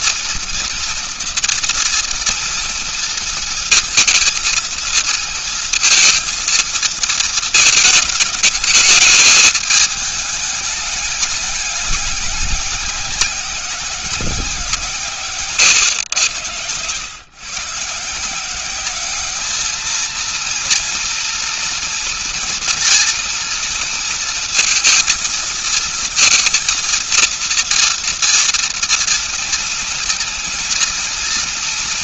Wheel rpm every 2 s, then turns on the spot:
230, 230, 230, 220, 210, 210, 190, 150, 110, 200, 230, 240, 230, 230, 230, 220.
none